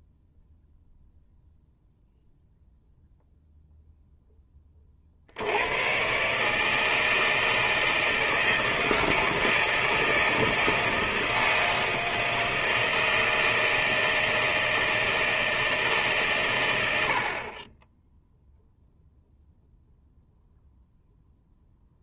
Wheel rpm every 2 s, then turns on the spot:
0, 0, 40, 160, 160, 160, 160, 160, 90, 0, 0.
none